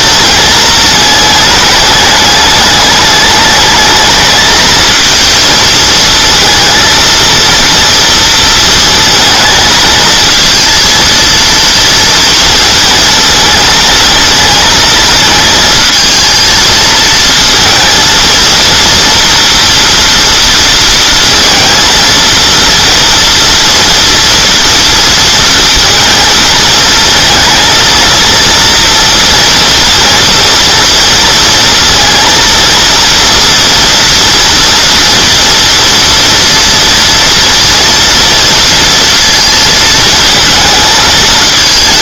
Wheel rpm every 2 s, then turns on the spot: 220, 210, 220, 230, 230, 230, 230, 220, 220, 230, 230, 230, 230, 220, 230, 230, 230, 230, 230, 230, 220.
none